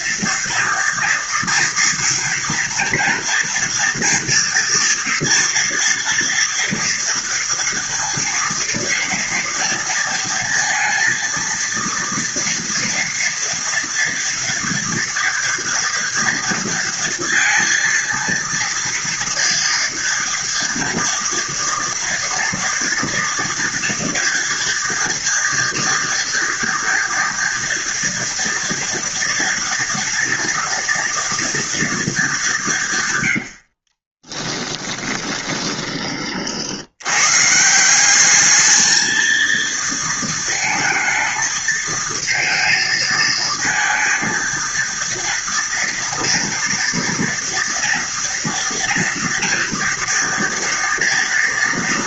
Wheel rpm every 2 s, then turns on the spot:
230, 230, 240, 230, 230, 230, 230, 230, 230, 230, 240, 230, 230, 230, 230, 230, 180, 10, 50, 210, 230, 220, 230, 230, 230, 230.
34-36